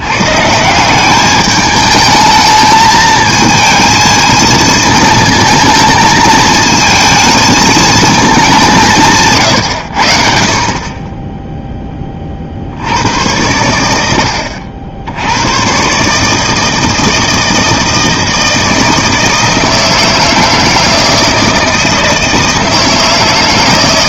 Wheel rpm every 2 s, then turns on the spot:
170, 220, 220, 220, 190, 40, 60, 70, 160, 160, 160, 160.
none